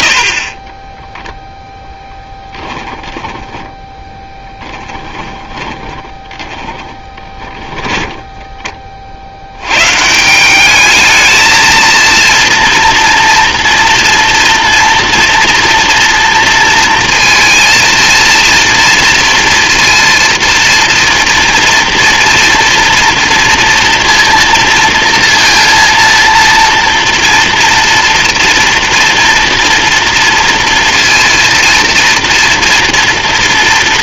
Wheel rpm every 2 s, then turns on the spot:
20, 10, 10, 20, 20, 200, 230, 230, 230, 230, 230, 230, 230, 230, 240, 230, 230.
0-8